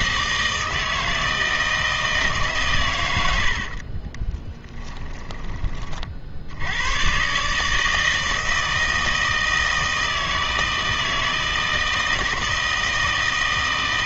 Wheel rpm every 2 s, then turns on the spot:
160, 130, 10, 90, 160, 160, 160.
4-6